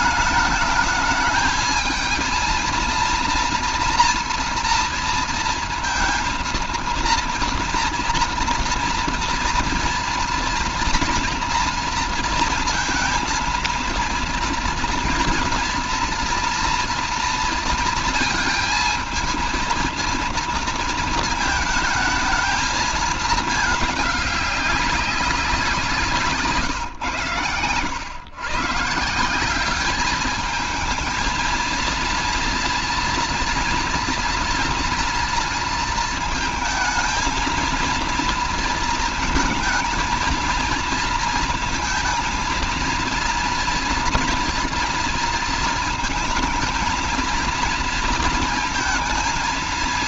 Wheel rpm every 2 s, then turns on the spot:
210, 230, 230, 230, 230, 230, 230, 230, 230, 230, 230, 220, 200, 150, 140, 220, 230, 230, 220, 230, 220, 230, 230, 220, 230.
none